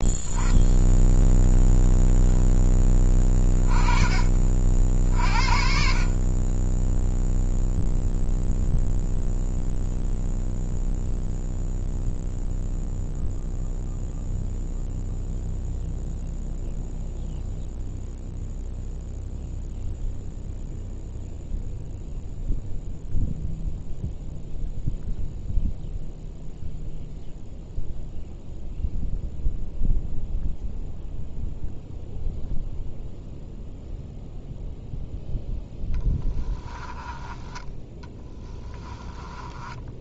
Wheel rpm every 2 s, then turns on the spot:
10, 20, 50, 0, 0, 0, 0, 0, 0, 0, 0, 0, 0, 0, 0, 0, 0, 0, 10, 20.
36-40